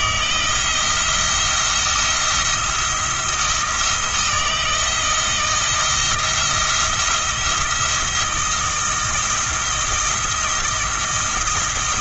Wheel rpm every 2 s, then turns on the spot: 170, 170, 160, 170, 170, 170.
none